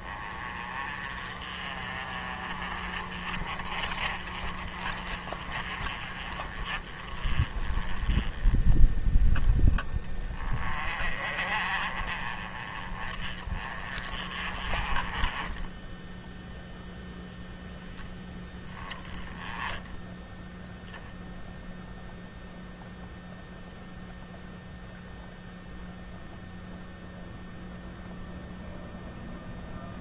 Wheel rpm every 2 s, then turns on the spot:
30, 30, 40, 30, 10, 30, 30, 30, 0, 0, 0, 0, 0, 0, 0.
none